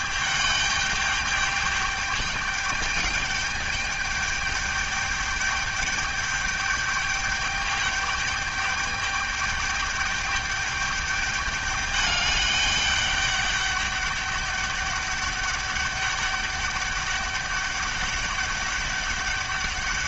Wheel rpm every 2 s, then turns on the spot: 210, 210, 210, 210, 210, 210, 200, 200, 200, 200.
none